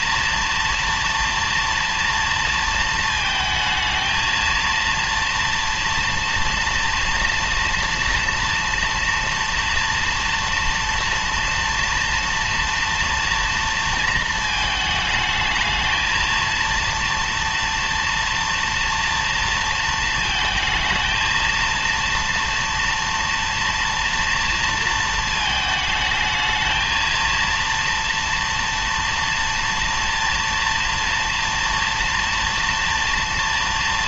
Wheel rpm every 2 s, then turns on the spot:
240, 230, 230, 230, 230, 230, 230, 220, 230, 230, 230, 230, 230, 220, 230, 230, 230.
none